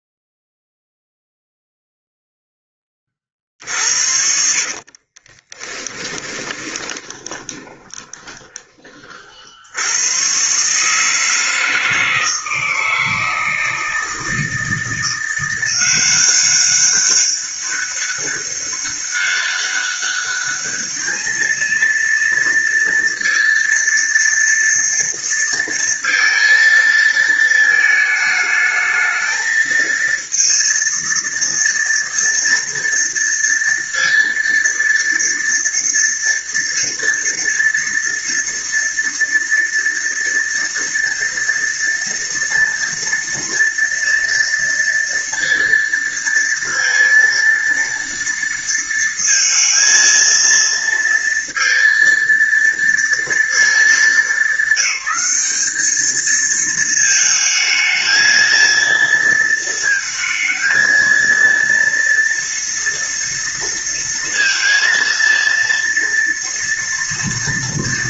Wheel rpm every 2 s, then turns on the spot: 0, 20, 40, 20, 30, 150, 160, 170, 190, 200, 210, 230, 230, 230, 220, 230, 230, 230, 230, 230, 230, 240, 230, 230, 230, 230, 230, 200, 220, 230, 230, 230, 230, 230.
4-8